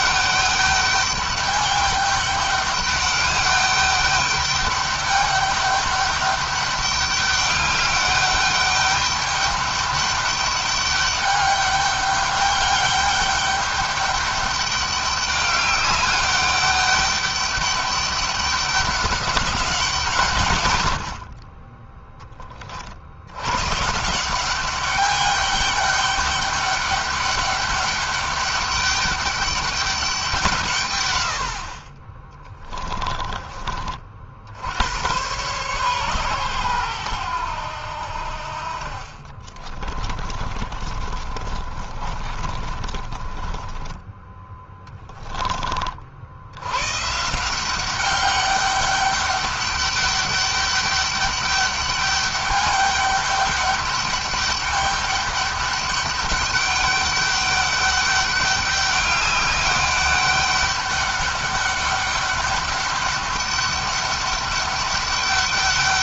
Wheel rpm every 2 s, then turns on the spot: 200, 200, 200, 200, 200, 200, 200, 200, 200, 200, 90, 50, 200, 200, 200, 130, 20, 90, 110, 50, 40, 30, 10, 120, 200, 200, 200, 200, 200, 200, 200, 200, 200.
32-34 38-46